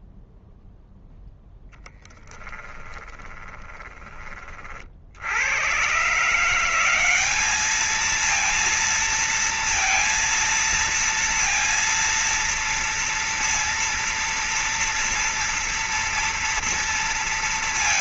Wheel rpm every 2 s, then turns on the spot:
0, 10, 50, 180, 230, 230, 230, 230, 230.
2-4